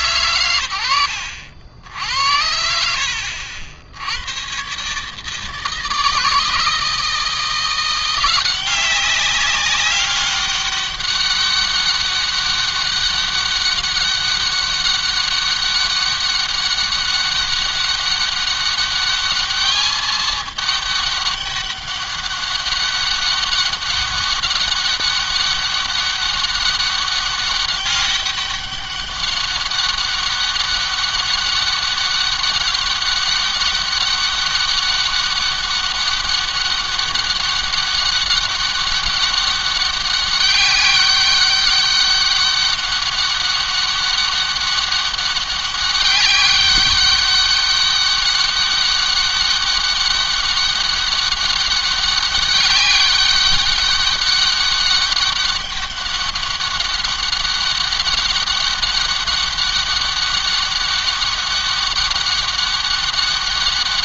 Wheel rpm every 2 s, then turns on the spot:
100, 70, 140, 160, 190, 200, 200, 200, 190, 200, 210, 200, 200, 200, 200, 200, 200, 200, 200, 200, 190, 200, 200, 200, 200, 200, 200, 200, 200, 200, 200, 200.
none